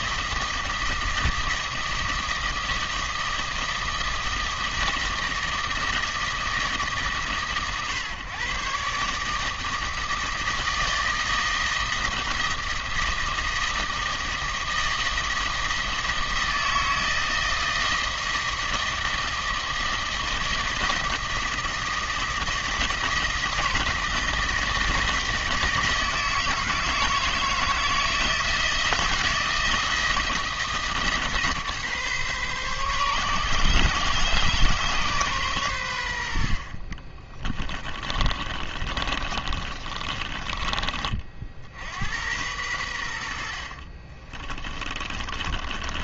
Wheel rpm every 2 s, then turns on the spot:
160, 160, 160, 160, 130, 160, 160, 160, 160, 160, 160, 160, 160, 160, 160, 160, 140, 130, 50, 30, 30, 100, 30.
38-40 44-46